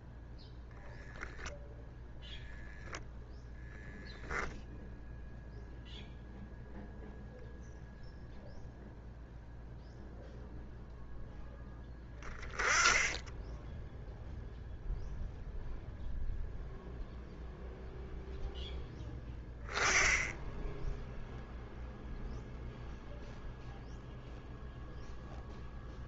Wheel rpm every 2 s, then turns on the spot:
0, 0, 0, 0, 0, 0, 20, 0, 0, 0, 10, 0, 0.
none